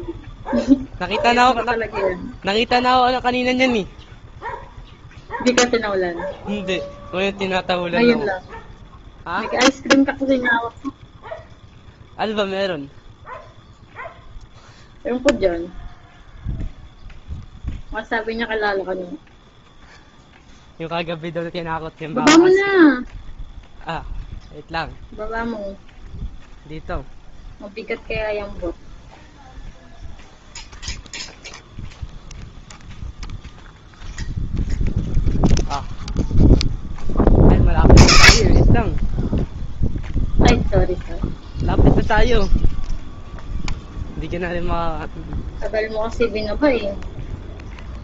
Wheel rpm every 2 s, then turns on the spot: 0, 0, 0, 0, 0, 0, 0, 0, 0, 0, 0, 0, 0, 0, 0, 0, 0, 0, 10, 20, 0, 0, 0, 0.
none